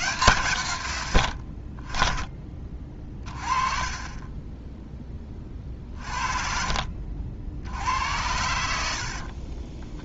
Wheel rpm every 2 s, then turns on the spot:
120, 30, 10, 40, 70.
none